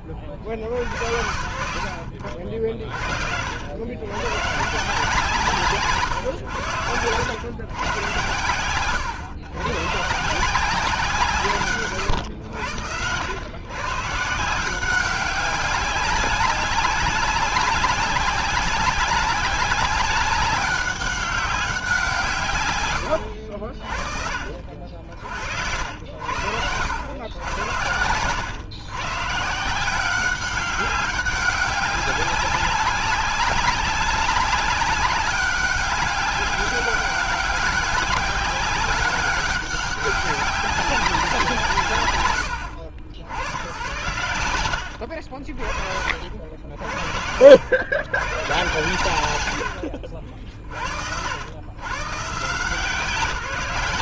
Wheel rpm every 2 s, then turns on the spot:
50, 50, 150, 100, 100, 180, 90, 180, 190, 190, 190, 100, 60, 90, 120, 190, 200, 190, 200, 190, 200, 80, 90, 60, 110, 80, 180.
24-26